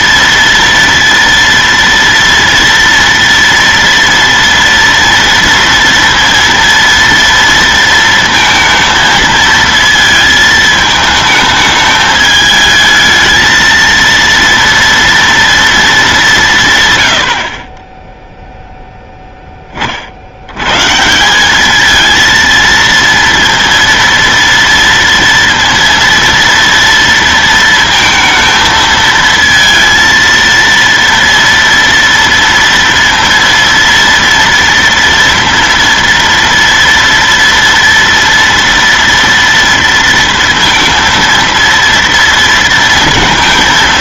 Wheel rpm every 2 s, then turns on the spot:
230, 230, 230, 230, 230, 220, 220, 230, 140, 0, 80, 230, 230, 230, 220, 230, 230, 230, 230, 230, 230, 230.
none